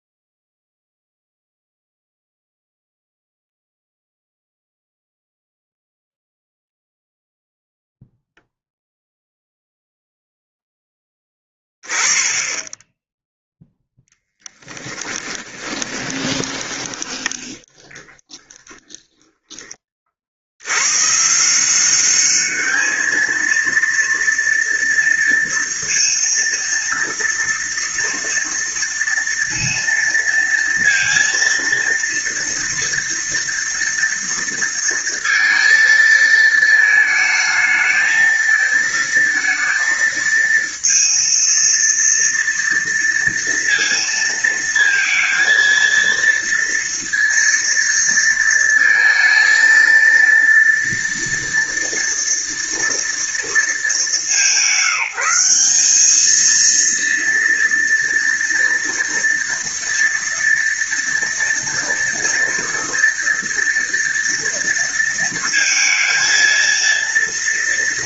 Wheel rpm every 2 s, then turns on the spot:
0, 0, 0, 0, 0, 0, 10, 10, 20, 10, 70, 210, 230, 230, 230, 230, 230, 230, 220, 220, 230, 230, 230, 230, 230, 230, 230, 180, 230, 230, 230, 230, 230, 230.
14-20